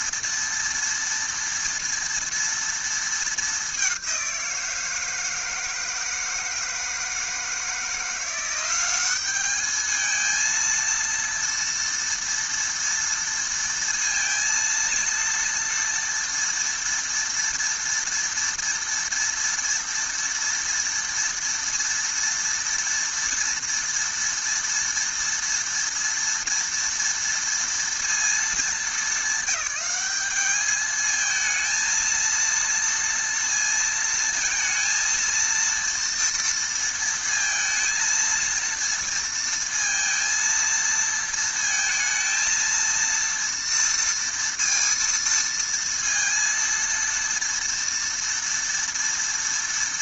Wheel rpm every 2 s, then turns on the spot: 230, 220, 160, 160, 200, 230, 230, 230, 230, 230, 230, 230, 230, 230, 200, 220, 230, 230, 230, 230, 230, 230, 230, 230, 230.
none